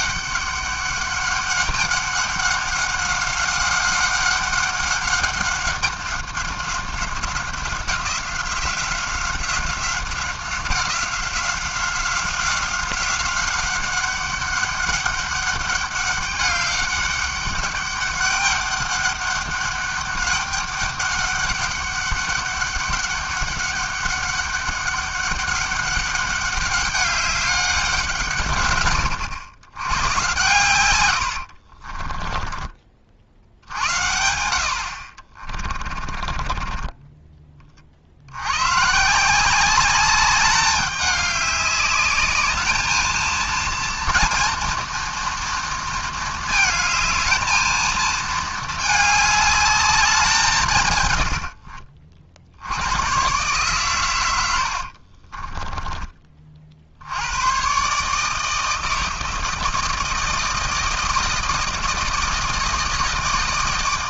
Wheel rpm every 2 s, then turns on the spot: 200, 190, 190, 190, 180, 190, 190, 200, 200, 200, 200, 200, 200, 200, 120, 110, 30, 70, 20, 110, 200, 220, 230, 220, 220, 160, 80, 80, 50, 160, 160, 160.
36-38 54-56